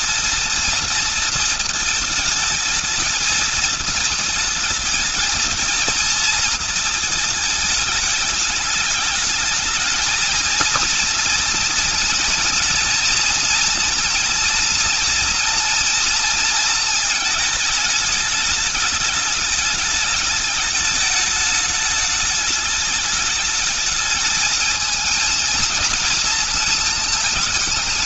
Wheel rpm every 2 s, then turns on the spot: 230, 220, 220, 220, 210, 230, 230, 230, 220, 210, 210, 210, 220, 230.
none